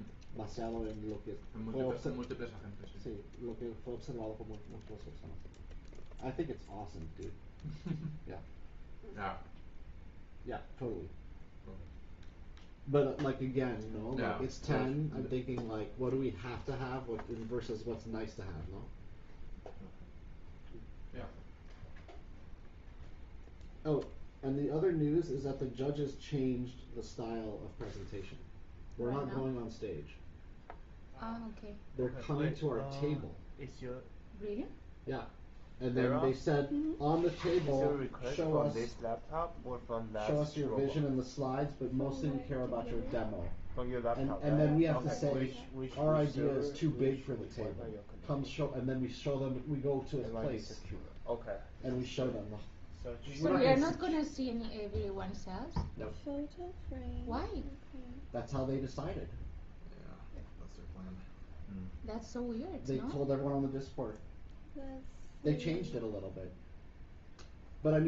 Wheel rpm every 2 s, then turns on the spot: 0, 0, 0, 0, 0, 0, 0, 0, 0, 0, 0, 0, 0, 0, 0, 0, 0, 0, 0, 0, 0, 0, 0, 0, 0, 0, 0, 0, 0, 0, 0, 0, 0, 0.
none